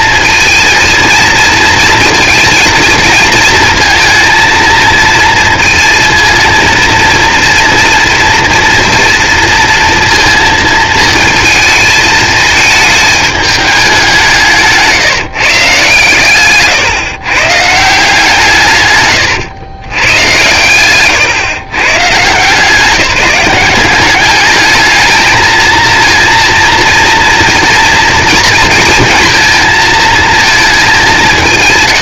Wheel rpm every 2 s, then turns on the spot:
230, 230, 230, 230, 240, 230, 220, 160, 150, 150, 120, 170, 210, 230, 230, 210.
14-18 20-22